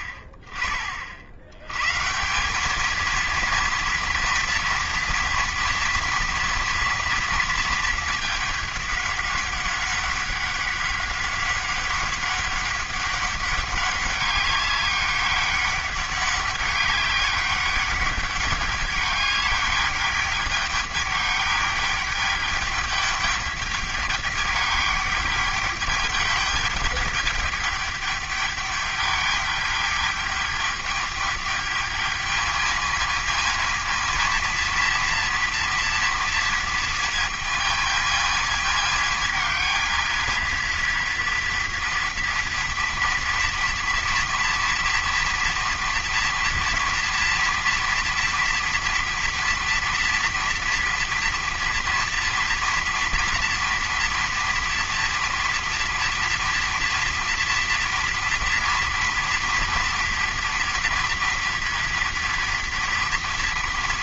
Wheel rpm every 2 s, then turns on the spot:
40, 210, 230, 230, 210, 200, 200, 200, 200, 210, 210, 210, 210, 210, 210, 210, 220, 230, 230, 220, 230, 230, 230, 230, 240, 230, 230, 230, 230, 230, 230, 230.
none